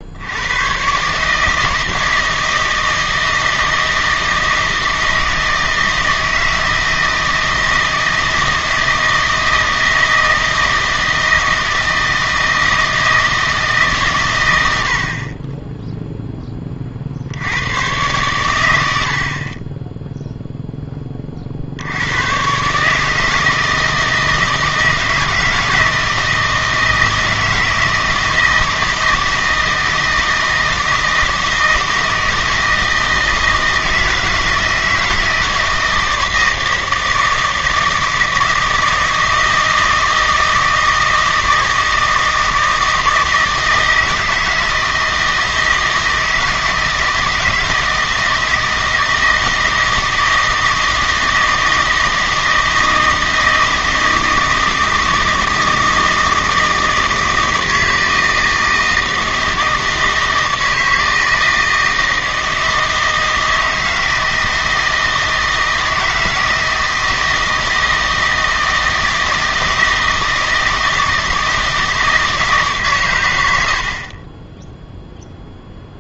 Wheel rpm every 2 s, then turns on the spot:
110, 160, 160, 160, 160, 160, 160, 90, 20, 100, 10, 140, 160, 160, 160, 160, 160, 160, 160, 160, 160, 160, 160, 160, 160, 160, 160, 160, 160, 160, 160, 160, 160, 160, 160, 160, 140, 10.
none